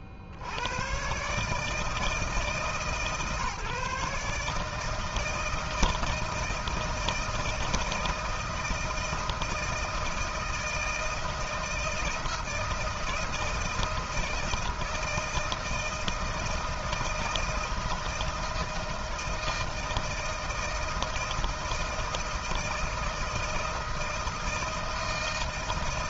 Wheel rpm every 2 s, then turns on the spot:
90, 150, 150, 160, 160, 160, 160, 160, 160, 160, 160, 160, 160.
none